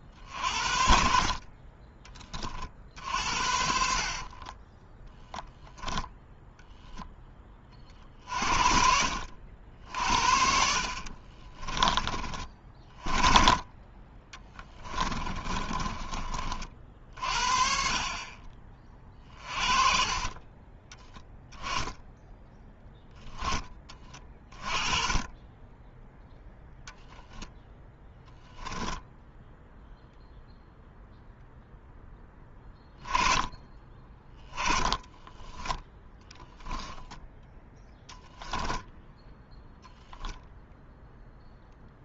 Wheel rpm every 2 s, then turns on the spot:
50, 50, 10, 10, 60, 50, 30, 20, 40, 30, 10, 10, 20, 10, 0, 0, 10, 20, 10, 10, 0.
4-6 10-12 14-16 26-28 34-36